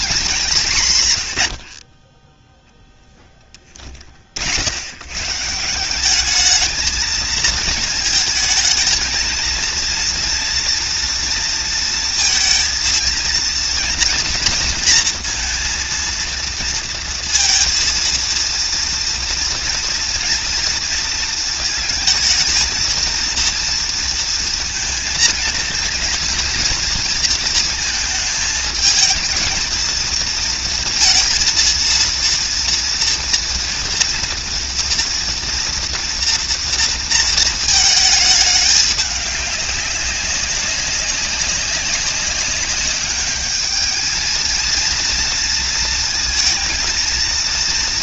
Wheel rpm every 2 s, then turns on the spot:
140, 0, 110, 220, 220, 230, 230, 230, 230, 230, 230, 230, 220, 230, 220, 230, 230, 230, 230, 210, 200, 200, 230, 230.
none